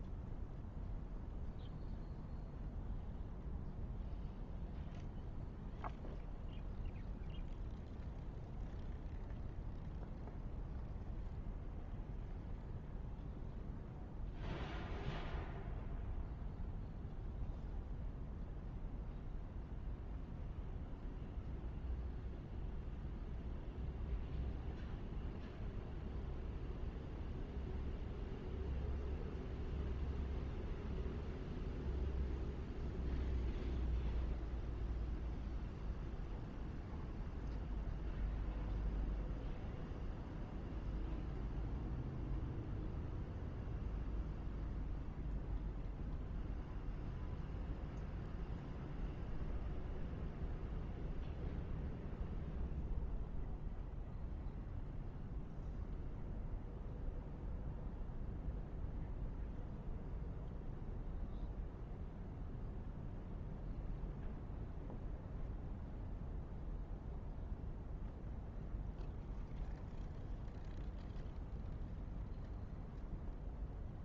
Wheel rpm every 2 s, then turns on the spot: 0, 0, 0, 0, 0, 0, 0, 0, 0, 0, 0, 0, 0, 0, 0, 0, 0, 0, 0, 0, 0, 0, 0, 0, 0, 0, 0, 0, 0, 0, 0, 0, 0, 0, 0, 0, 0.
none